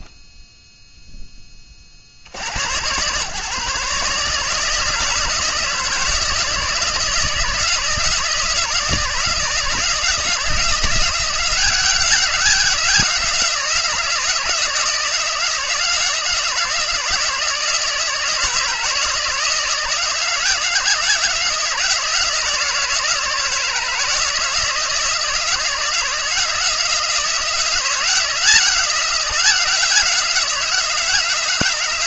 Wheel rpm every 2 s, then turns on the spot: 10, 110, 160, 160, 160, 170, 190, 160, 160, 160, 160, 160, 160, 170, 180, 170.
none